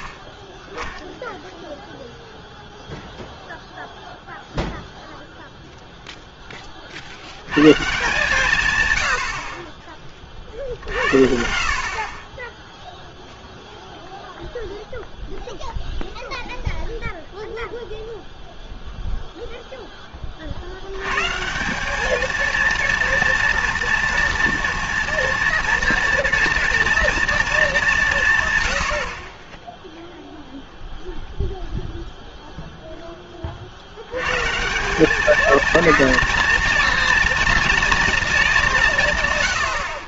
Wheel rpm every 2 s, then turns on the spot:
20, 0, 0, 20, 160, 50, 20, 0, 0, 0, 50, 230, 230, 230, 130, 0, 0, 110, 230, 210.
none